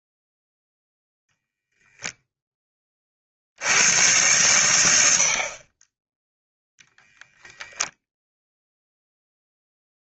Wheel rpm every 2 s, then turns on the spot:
0, 20, 100, 0, 0.
none